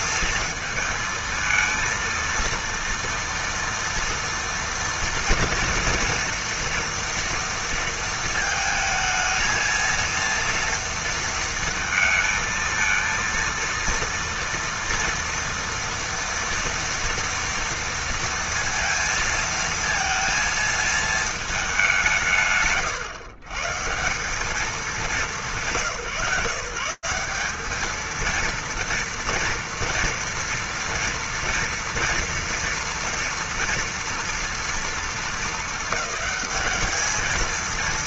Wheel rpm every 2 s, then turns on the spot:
230, 230, 230, 230, 230, 230, 230, 230, 230, 230, 230, 130, 200, 150, 230, 230, 230, 230, 210.
none